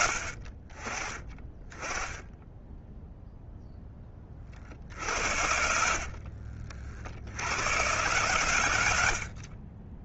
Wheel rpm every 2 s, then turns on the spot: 20, 10, 50, 50, 90.
none